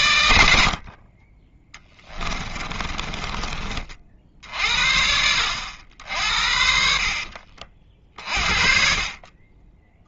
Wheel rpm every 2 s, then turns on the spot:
60, 30, 60, 60, 40.
2-4 6-8